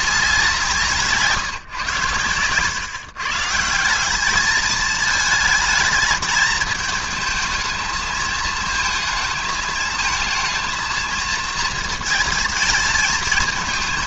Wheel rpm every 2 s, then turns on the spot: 180, 130, 210, 210, 220, 230, 220.
none